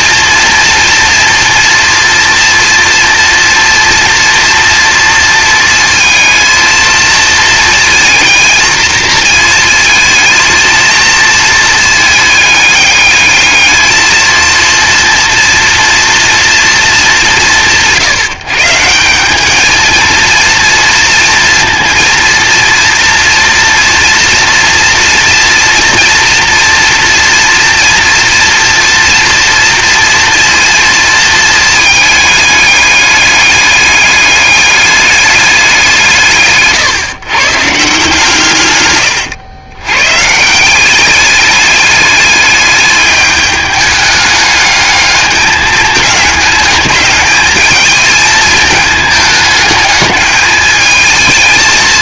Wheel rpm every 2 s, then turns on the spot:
230, 230, 230, 230, 230, 230, 210, 230, 220, 160, 240, 230, 230, 230, 230, 230, 210, 210, 130, 110, 180, 210, 210, 210, 220, 220.
none